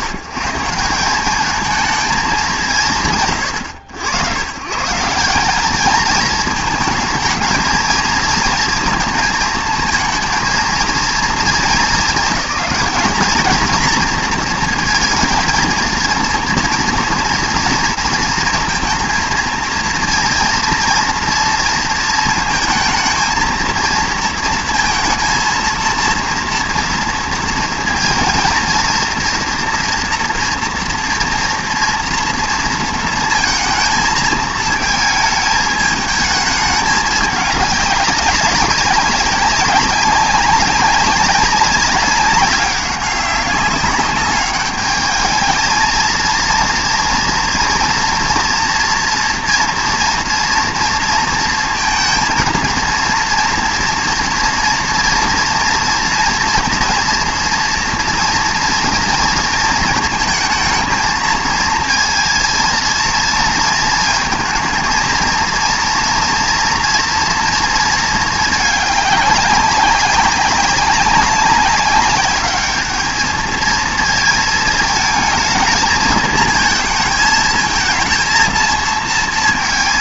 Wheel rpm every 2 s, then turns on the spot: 150, 180, 120, 220, 230, 230, 210, 220, 230, 230, 230, 220, 230, 230, 230, 230, 230, 220, 210, 190, 200, 190, 210, 230, 230, 230, 230, 230, 230, 230, 220, 230, 230, 240, 210, 200, 210, 220, 220, 220.
none